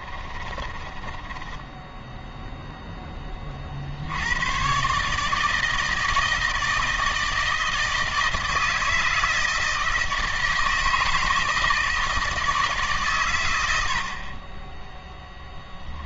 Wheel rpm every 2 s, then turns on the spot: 20, 10, 130, 160, 160, 160, 140, 10.
0-2